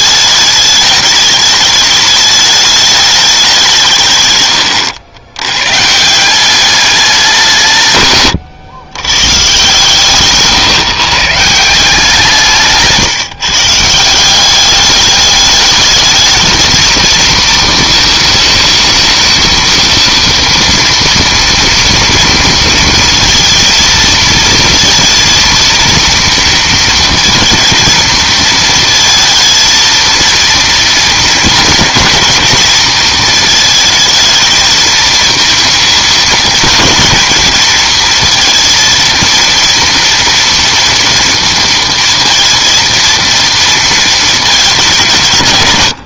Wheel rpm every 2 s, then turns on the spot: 210, 210, 100, 200, 120, 130, 160, 200, 220, 220, 230, 230, 230, 230, 220, 230, 220, 220, 230, 230, 230, 230, 180.
4-6